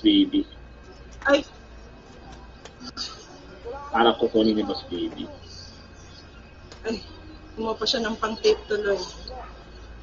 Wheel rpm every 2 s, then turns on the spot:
0, 0, 0, 0, 0.
none